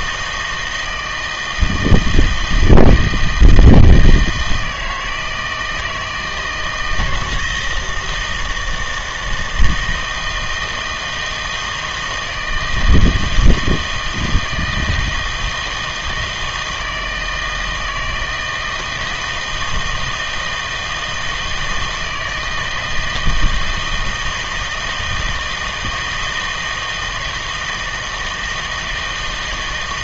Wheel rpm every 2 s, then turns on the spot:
160, 160, 160, 160, 160, 160, 160, 160, 160, 160, 160, 160, 160, 160, 160.
none